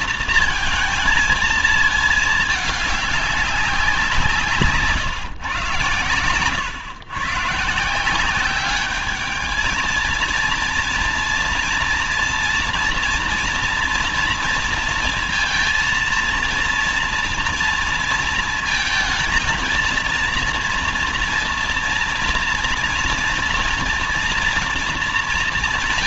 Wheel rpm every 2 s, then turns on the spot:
220, 210, 150, 120, 190, 230, 230, 230, 230, 230, 230, 230, 240.
none